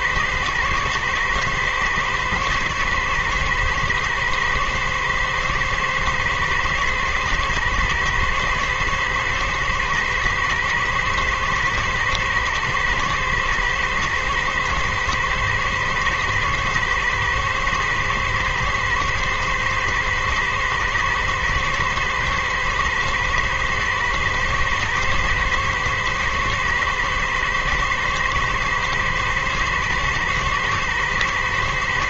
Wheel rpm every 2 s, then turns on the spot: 120, 120, 110, 110, 110, 120, 110, 110, 110, 120, 110, 120, 110, 110, 120, 120.
none